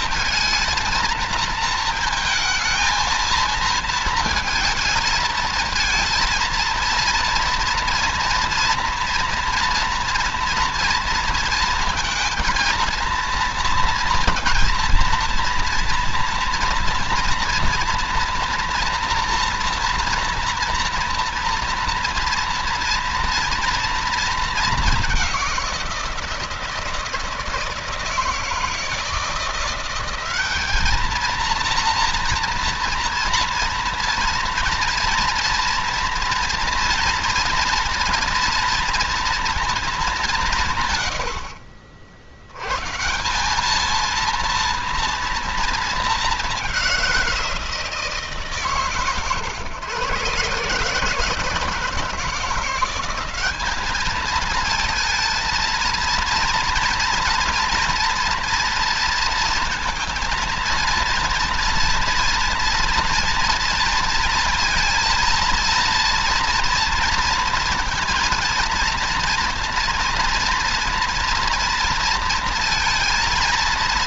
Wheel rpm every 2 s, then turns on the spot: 220, 230, 220, 230, 240, 230, 230, 230, 230, 240, 230, 230, 210, 160, 160, 210, 230, 230, 240, 230, 150, 130, 230, 190, 140, 140, 180, 220, 230, 230, 230, 230, 230, 230, 230, 240, 230.
none